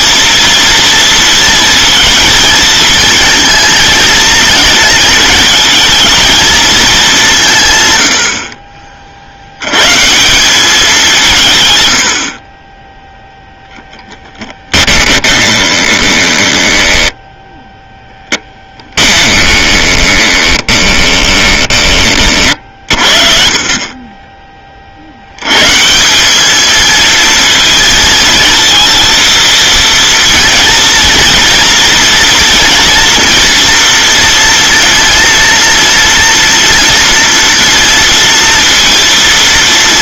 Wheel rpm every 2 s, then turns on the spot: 230, 220, 220, 220, 40, 190, 20, 10, 10, 10, 20, 50, 30, 220, 230, 230, 230, 230, 230, 230.
14-24